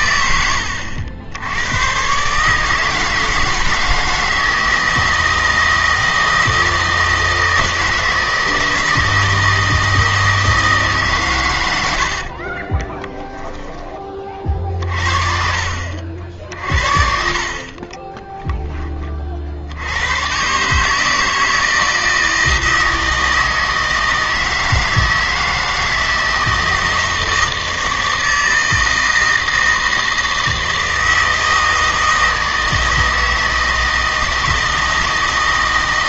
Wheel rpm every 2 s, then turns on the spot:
80, 150, 160, 160, 160, 160, 30, 50, 50, 10, 150, 160, 160, 160, 160, 160, 160, 160.
12-14 16-18